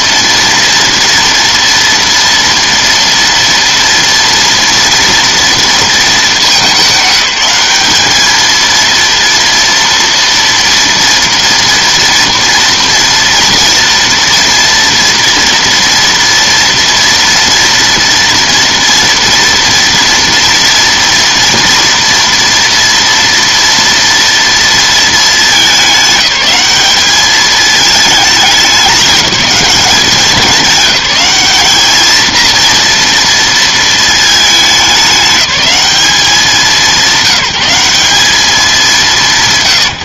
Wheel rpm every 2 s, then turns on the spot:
230, 230, 230, 200, 230, 230, 230, 230, 230, 230, 240, 240, 230, 210, 210, 200, 230, 210, 200, 190.
none